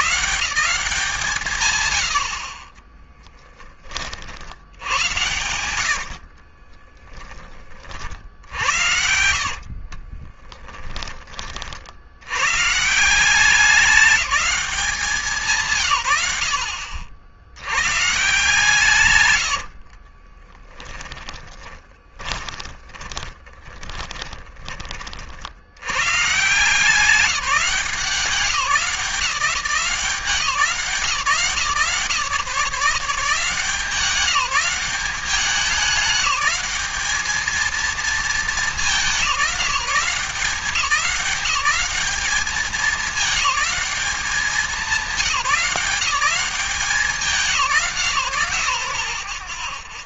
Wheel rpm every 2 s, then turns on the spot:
180, 20, 100, 30, 70, 20, 160, 190, 70, 130, 10, 20, 40, 180, 190, 160, 160, 190, 210, 200, 190, 210, 190, 180, 100.
2-4 6-10 20-24